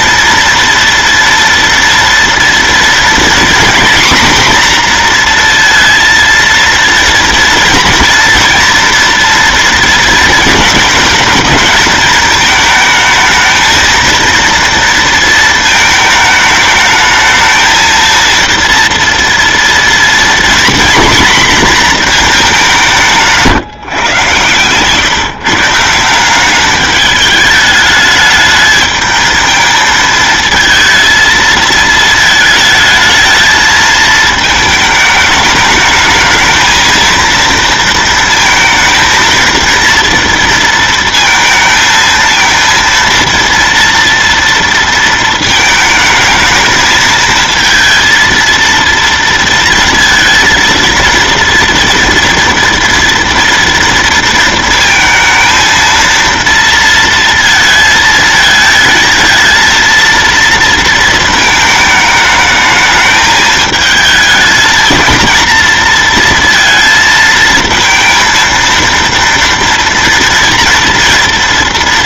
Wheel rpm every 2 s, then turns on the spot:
230, 230, 240, 230, 230, 220, 220, 230, 210, 230, 240, 180, 130, 200, 210, 220, 220, 220, 230, 230, 230, 230, 230, 220, 230, 230, 230, 220, 230, 220, 230, 210, 230, 230, 230, 230.
none